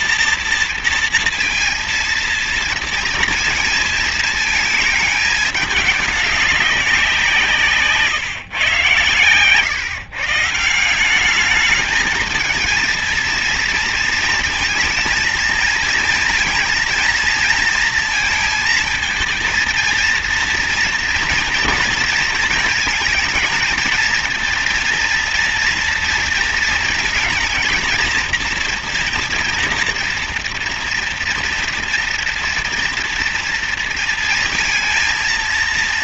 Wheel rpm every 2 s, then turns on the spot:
230, 230, 220, 190, 130, 160, 220, 230, 230, 230, 230, 230, 230, 230, 240, 230, 230, 230.
none